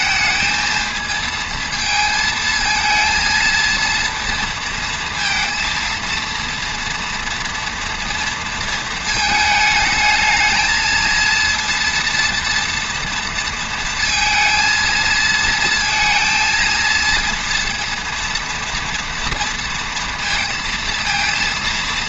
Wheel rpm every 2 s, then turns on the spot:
230, 230, 230, 230, 220, 230, 230, 230, 230, 230, 230.
none